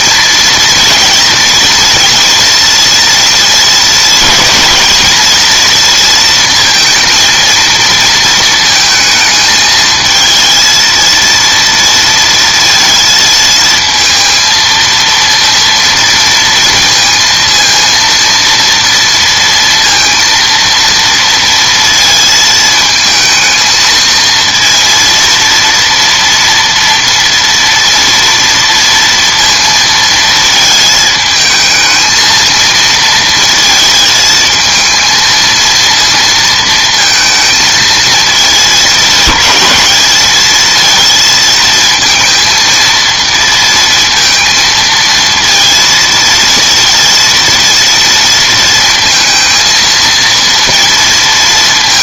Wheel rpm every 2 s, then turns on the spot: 230, 240, 230, 230, 230, 220, 230, 230, 230, 230, 230, 220, 230, 230, 230, 220, 230, 220, 220, 210, 220, 230, 230, 230, 230, 230.
none